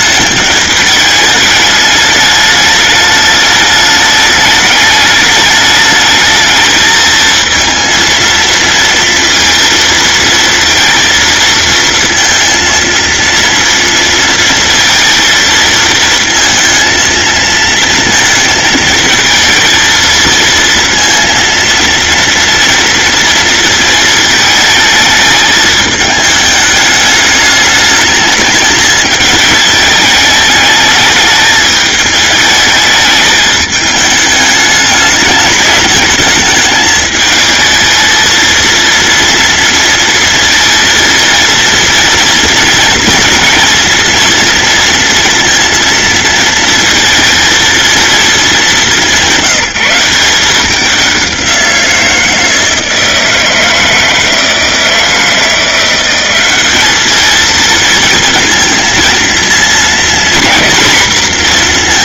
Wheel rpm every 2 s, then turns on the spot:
210, 210, 210, 220, 230, 230, 230, 230, 230, 220, 230, 230, 220, 210, 220, 210, 210, 210, 220, 230, 230, 230, 230, 230, 210, 190, 160, 160, 200, 230, 240.
none